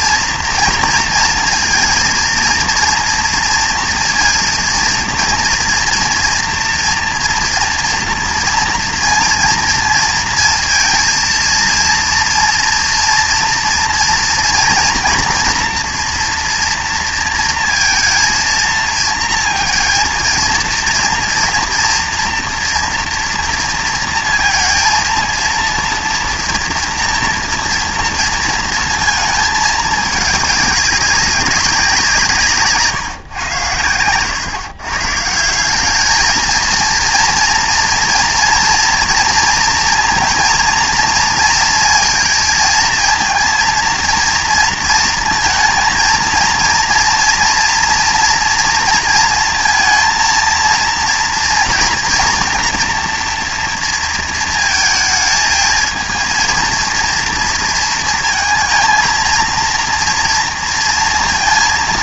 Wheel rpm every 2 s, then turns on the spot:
230, 230, 230, 240, 230, 230, 230, 230, 230, 230, 230, 230, 230, 230, 230, 200, 150, 130, 220, 230, 230, 230, 230, 230, 230, 230, 240, 230, 230, 220, 230.
32-34